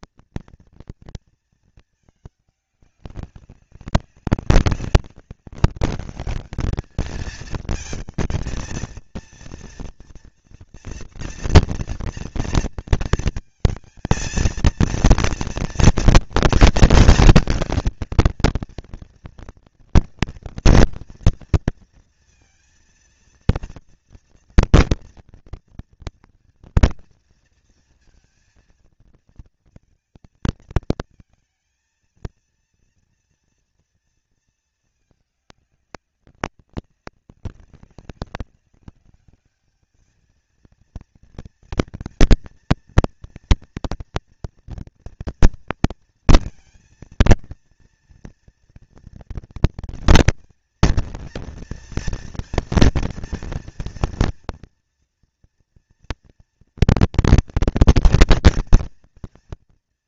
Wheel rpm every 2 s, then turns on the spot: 230, 200, 200, 220, 230, 240, 230, 230, 230, 230, 230, 230, 230, 230, 230, 220, 230, 210, 200, 200, 230, 230, 230, 230, 230, 230, 230, 230, 230, 230.
none